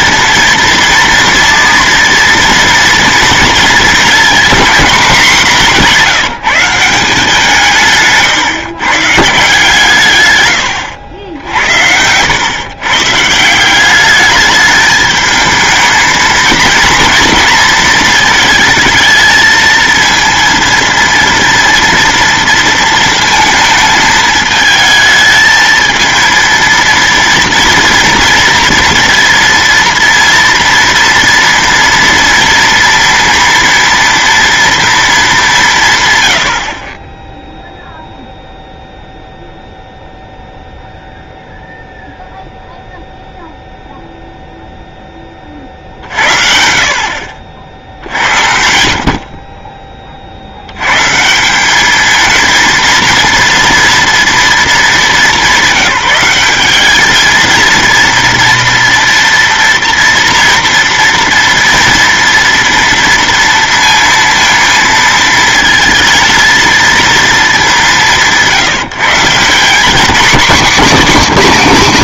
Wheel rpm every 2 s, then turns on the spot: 230, 230, 220, 170, 140, 90, 140, 210, 230, 220, 230, 230, 220, 230, 240, 230, 230, 230, 40, 0, 0, 0, 10, 60, 60, 120, 230, 220, 210, 240, 230, 230, 230, 230, 170, 210.
70-72